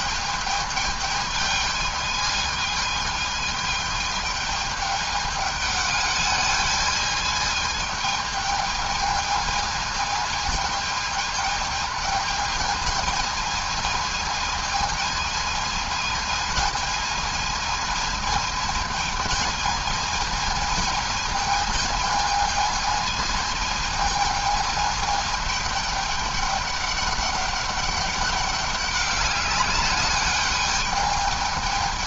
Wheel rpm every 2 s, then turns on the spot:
210, 220, 210, 210, 220, 210, 220, 220, 220, 220, 220, 220, 220, 210, 200, 200.
none